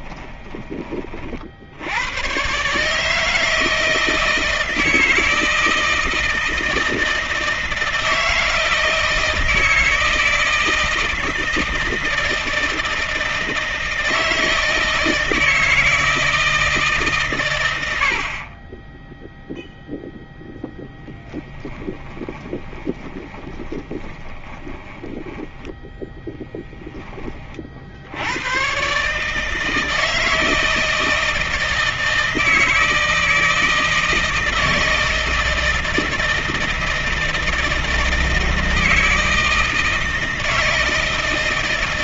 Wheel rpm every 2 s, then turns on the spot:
30, 150, 160, 160, 160, 160, 160, 160, 140, 20, 0, 20, 10, 20, 140, 160, 160, 160, 170, 160, 160.
22-26